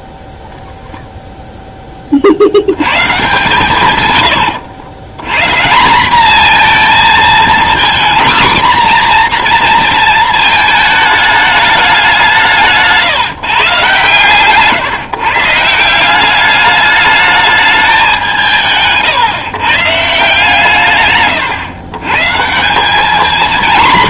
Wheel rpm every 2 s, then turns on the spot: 0, 110, 100, 230, 250, 220, 160, 150, 210, 150, 140, 190.
none